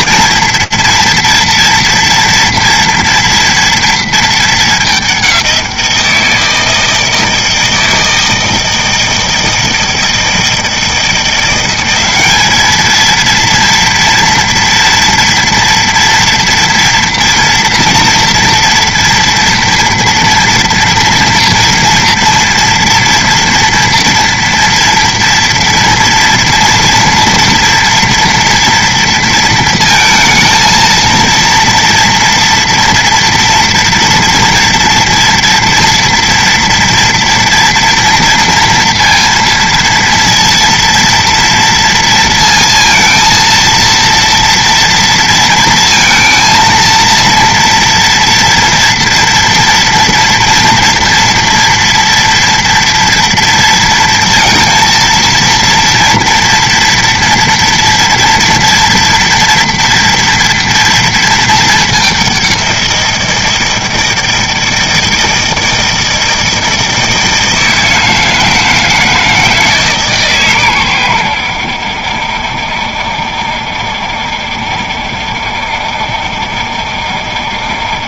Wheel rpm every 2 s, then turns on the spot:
230, 230, 210, 160, 160, 160, 210, 240, 230, 230, 230, 230, 230, 240, 230, 230, 230, 230, 230, 230, 230, 230, 230, 230, 230, 230, 230, 230, 230, 230, 230, 180, 160, 160, 160, 120, 70, 70, 60.
none